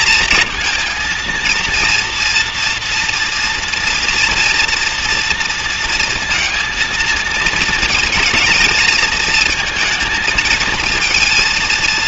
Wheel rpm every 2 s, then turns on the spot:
220, 230, 240, 230, 220, 220.
none